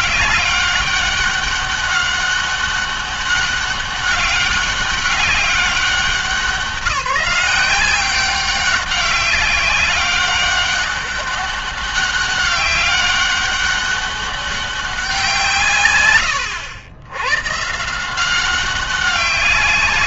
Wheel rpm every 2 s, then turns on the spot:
200, 200, 200, 190, 190, 200, 200, 190, 100, 190.
none